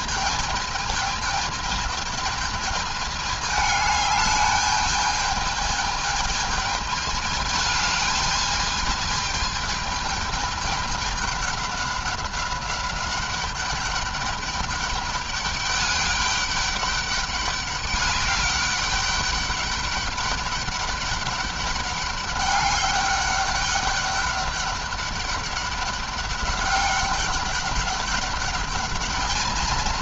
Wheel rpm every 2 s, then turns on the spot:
220, 220, 210, 220, 210, 210, 200, 200, 200, 200, 200, 200, 200, 200, 200.
none